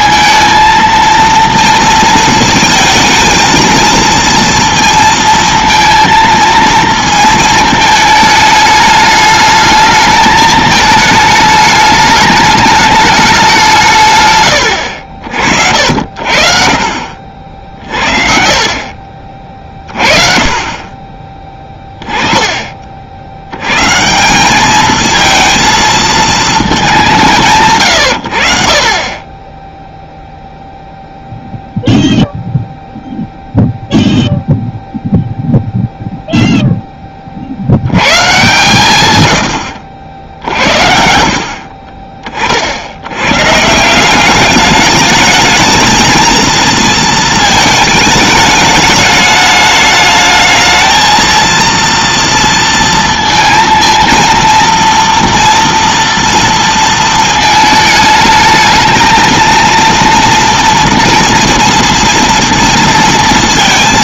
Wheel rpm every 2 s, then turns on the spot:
230, 220, 230, 230, 210, 220, 210, 90, 60, 50, 20, 40, 210, 210, 50, 0, 0, 0, 0, 130, 60, 70, 210, 230, 210, 220, 230, 230, 230, 220, 230, 230.
18-20 40-42